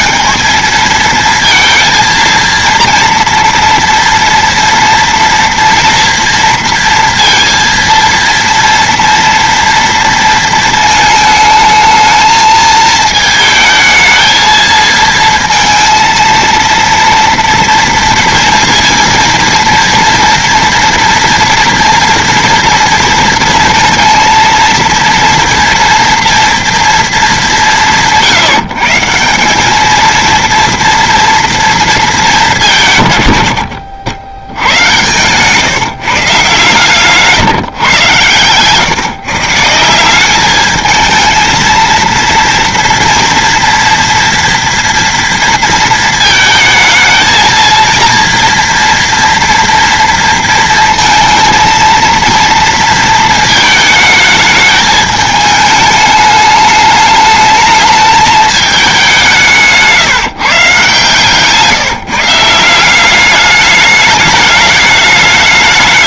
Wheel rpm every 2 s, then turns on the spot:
220, 230, 240, 230, 230, 230, 220, 220, 230, 230, 230, 230, 230, 230, 160, 230, 160, 100, 140, 140, 220, 230, 230, 220, 230, 230, 230, 210, 210, 210, 150, 170, 210.
none